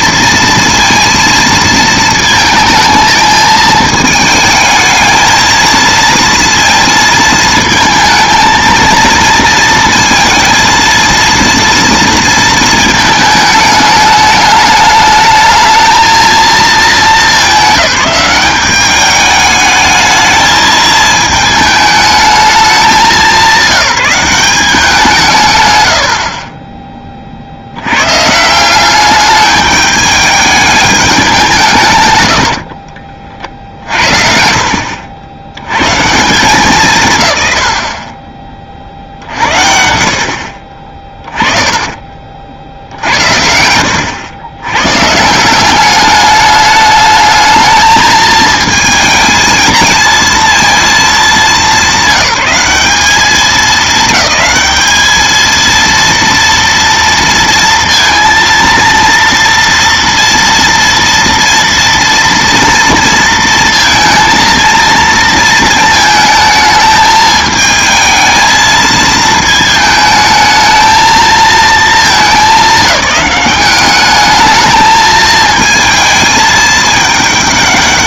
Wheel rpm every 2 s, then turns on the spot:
230, 220, 220, 230, 230, 230, 230, 210, 220, 200, 220, 210, 190, 20, 170, 210, 60, 60, 160, 40, 50, 50, 100, 210, 220, 220, 200, 200, 230, 230, 230, 230, 230, 220, 220, 220, 210, 220, 210.
32-34